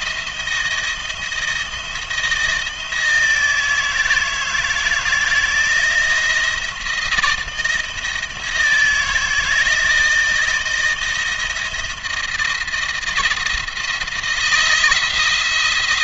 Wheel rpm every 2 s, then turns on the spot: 160, 160, 160, 170, 160, 160, 170, 160.
none